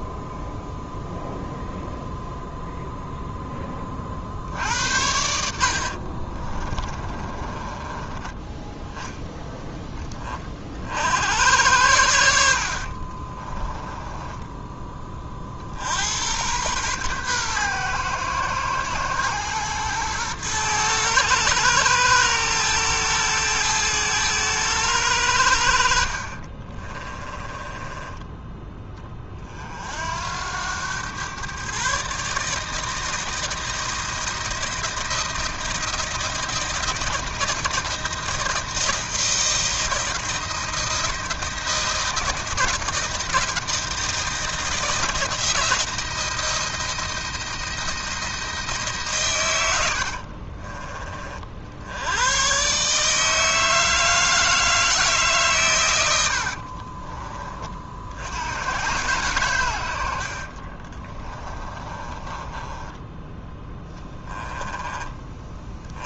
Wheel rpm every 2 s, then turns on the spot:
0, 0, 70, 30, 10, 50, 60, 10, 120, 110, 110, 110, 100, 30, 20, 90, 150, 160, 160, 160, 170, 160, 170, 160, 160, 40, 130, 160, 60, 100, 60, 20, 10.
6-8 26-28 50-52 56-58 60-64